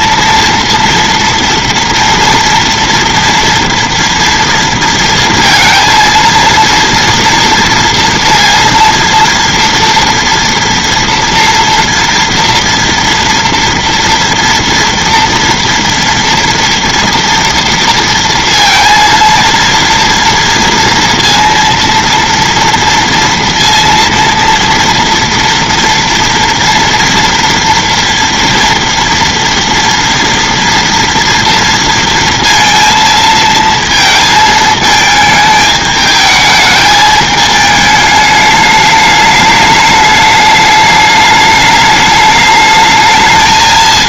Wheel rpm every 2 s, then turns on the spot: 230, 230, 230, 230, 230, 240, 230, 240, 230, 230, 230, 230, 230, 230, 230, 230, 230, 220, 210, 210, 210, 210.
none